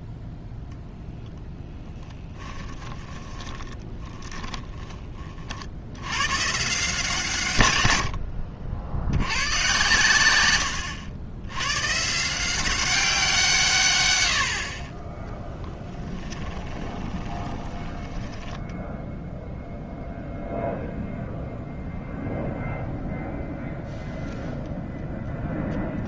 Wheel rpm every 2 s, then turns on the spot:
0, 20, 20, 140, 80, 100, 180, 60, 20, 0, 0, 0, 0.
2-6 10-12 16-18